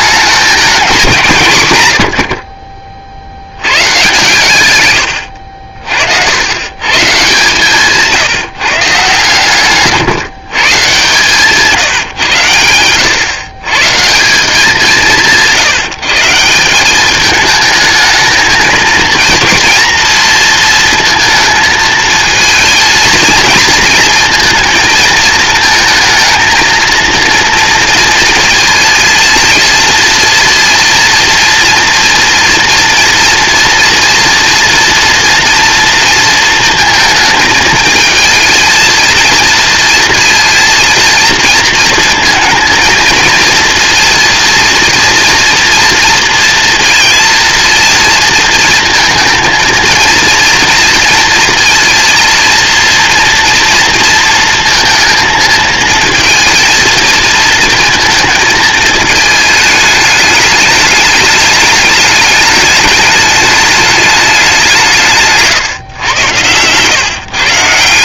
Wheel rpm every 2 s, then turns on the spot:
210, 50, 130, 100, 150, 140, 100, 170, 170, 220, 230, 230, 230, 230, 230, 230, 230, 240, 230, 230, 230, 230, 240, 230, 220, 230, 230, 230, 230, 220, 210, 210, 180, 120.
none